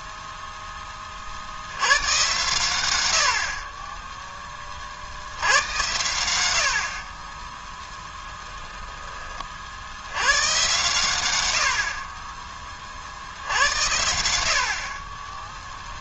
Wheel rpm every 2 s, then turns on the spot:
30, 90, 50, 40, 20, 110, 50, 30.
14-16